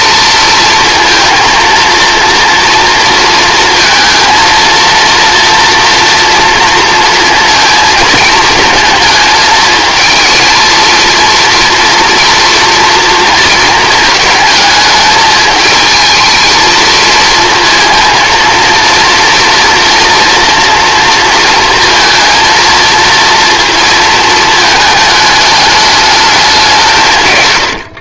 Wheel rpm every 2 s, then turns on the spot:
230, 230, 230, 230, 220, 230, 230, 220, 230, 230, 230, 230, 220, 180.
none